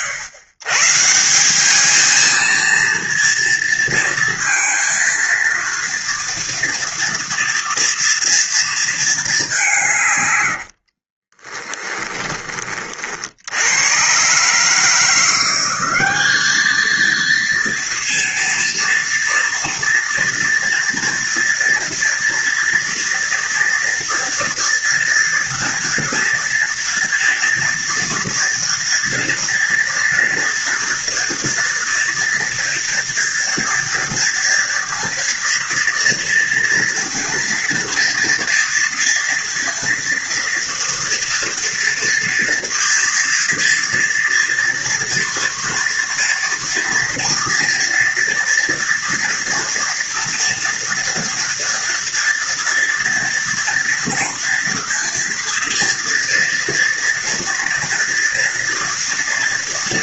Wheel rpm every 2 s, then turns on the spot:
120, 230, 230, 240, 230, 70, 30, 150, 220, 230, 240, 240, 240, 240, 240, 230, 230, 230, 230, 230, 230, 230, 230, 230, 240, 230, 240, 230, 230, 240.
10-12